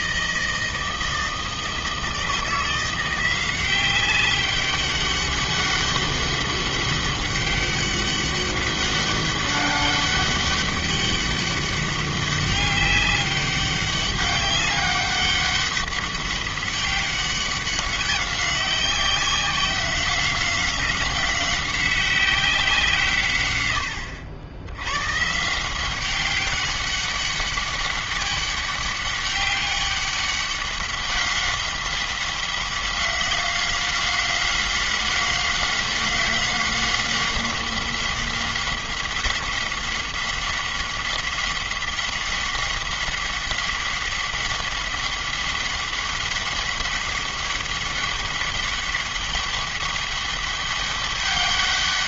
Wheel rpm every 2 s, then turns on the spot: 160, 170, 200, 200, 200, 200, 200, 200, 200, 190, 190, 160, 110, 200, 200, 190, 190, 190, 190, 190, 190, 190, 190, 200, 200, 200.
none